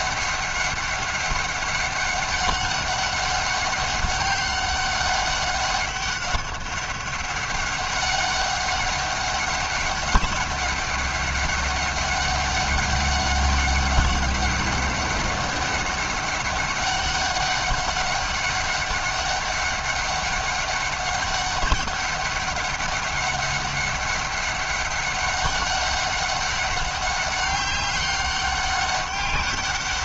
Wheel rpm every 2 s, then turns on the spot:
190, 200, 200, 200, 200, 200, 200, 200, 200, 200, 200, 200, 200, 200, 200.
none